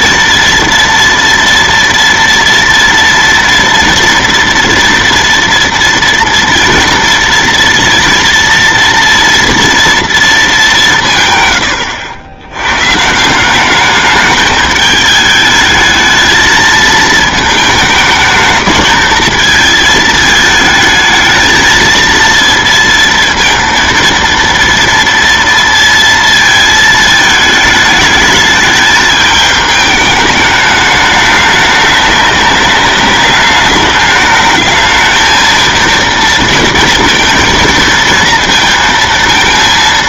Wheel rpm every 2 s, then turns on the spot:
230, 230, 230, 230, 230, 200, 120, 210, 220, 220, 220, 230, 230, 220, 210, 210, 200, 220, 230, 230.
none